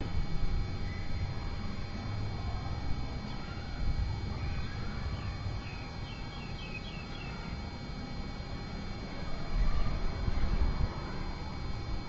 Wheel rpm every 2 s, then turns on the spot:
0, 0, 0, 0, 0, 0.
none